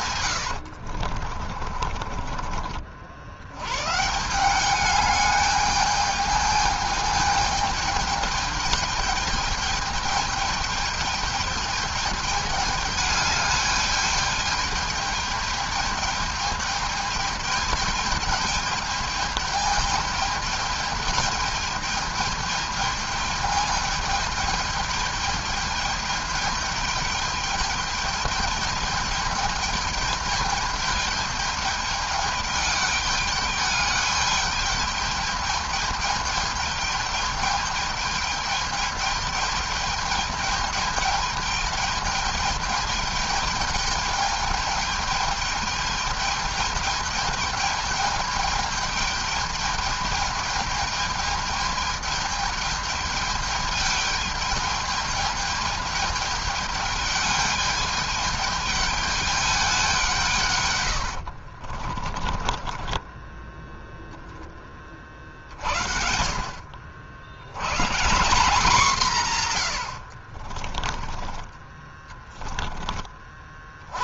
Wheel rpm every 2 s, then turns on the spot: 80, 40, 180, 210, 210, 210, 210, 210, 210, 210, 210, 210, 210, 210, 210, 210, 210, 210, 210, 210, 210, 210, 210, 210, 210, 210, 210, 210, 210, 210, 130, 20, 20, 60, 200, 40, 30.
0-2 62-64 70-72